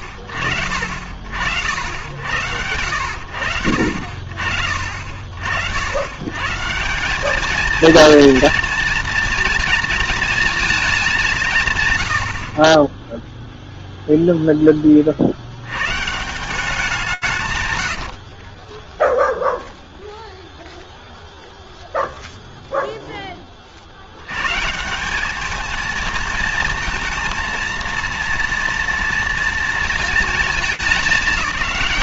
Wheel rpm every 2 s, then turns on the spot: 70, 80, 50, 150, 230, 220, 40, 0, 180, 20, 0, 10, 210, 230, 230, 200.
18-20